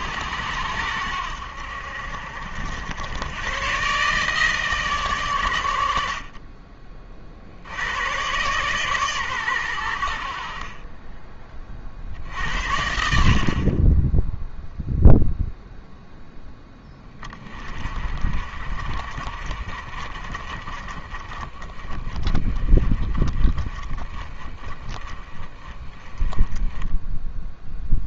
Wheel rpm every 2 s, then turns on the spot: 90, 70, 150, 40, 130, 40, 70, 0, 20, 40, 30, 30, 30, 10.
none